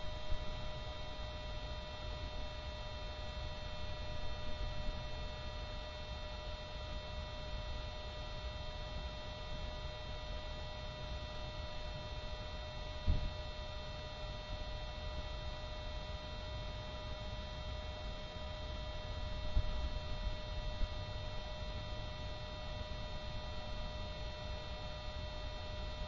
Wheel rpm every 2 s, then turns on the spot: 0, 0, 0, 0, 0, 0, 0, 0, 0, 0, 0, 0, 0.
none